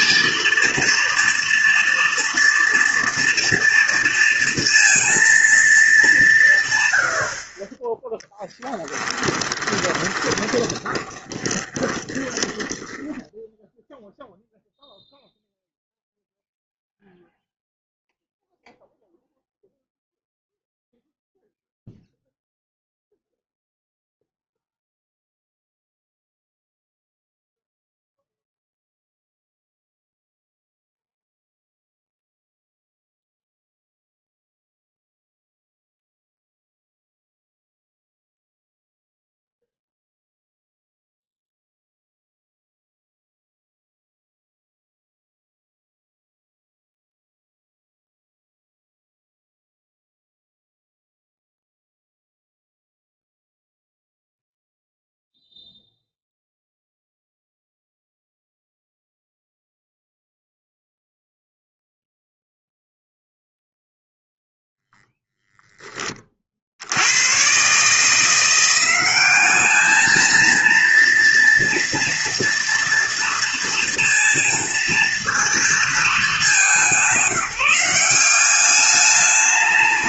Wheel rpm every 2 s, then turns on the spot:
230, 230, 230, 110, 10, 20, 10, 0, 0, 0, 0, 0, 0, 0, 0, 0, 0, 0, 0, 0, 0, 0, 0, 0, 0, 0, 0, 0, 0, 0, 0, 0, 0, 80, 180, 230, 230, 230, 190, 200.
8-14